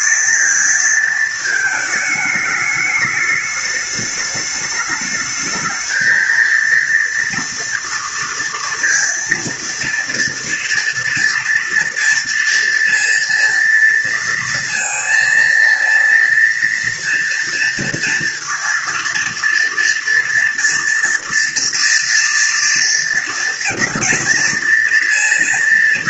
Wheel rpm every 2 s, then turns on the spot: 230, 210, 210, 230, 230, 230, 230, 230, 230, 230, 240, 230, 230.
none